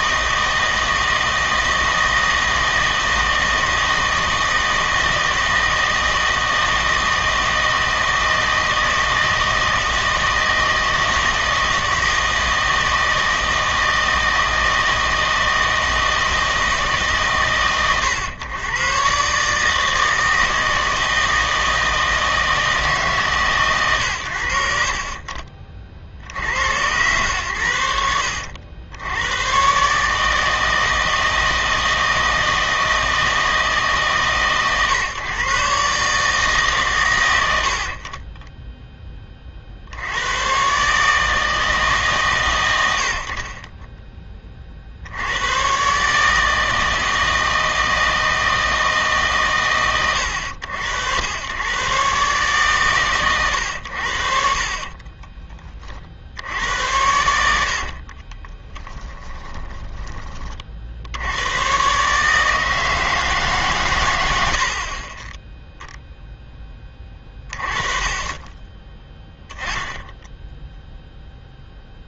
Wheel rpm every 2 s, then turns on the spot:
160, 160, 160, 160, 160, 160, 160, 160, 160, 120, 160, 160, 60, 90, 90, 160, 160, 130, 140, 10, 120, 120, 40, 160, 160, 80, 140, 40, 80, 10, 60, 160, 70, 10, 20, 0.
58-60